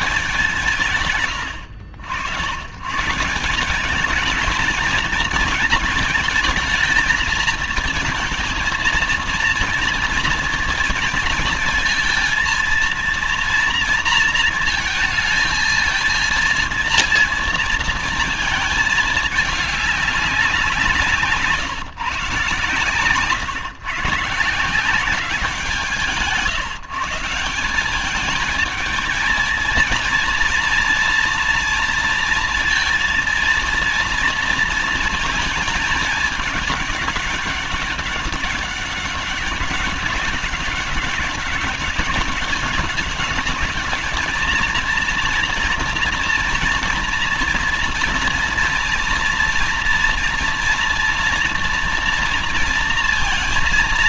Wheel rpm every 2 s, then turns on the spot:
160, 90, 220, 230, 220, 230, 230, 220, 230, 220, 190, 140, 150, 160, 210, 230, 230, 230, 210, 200, 200, 200, 220, 230, 240, 240, 230.
none